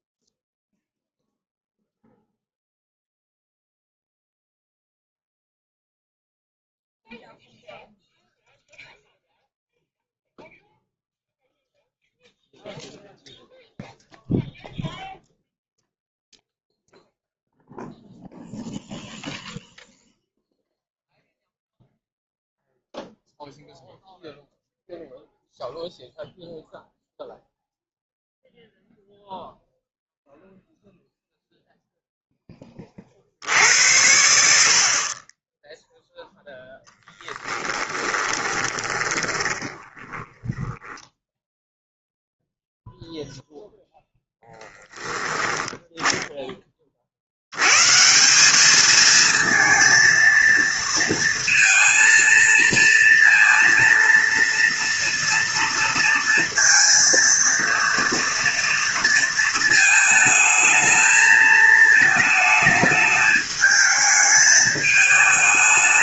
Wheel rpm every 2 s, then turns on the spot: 0, 0, 0, 0, 0, 0, 0, 0, 0, 0, 0, 0, 0, 0, 0, 0, 20, 60, 0, 20, 20, 0, 0, 20, 200, 230, 230, 230, 230, 230, 220, 220, 220.
38-42